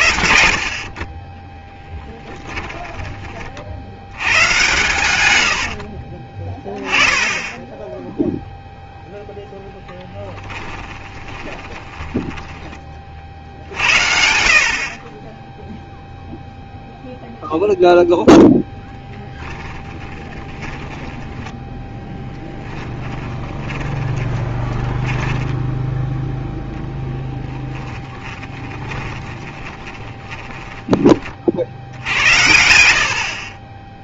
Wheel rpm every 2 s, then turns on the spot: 20, 60, 60, 10, 0, 20, 70, 10, 0, 10, 10, 30, 10, 10, 20, 20, 60.
0-2 4-6 10-12 18-26 28-30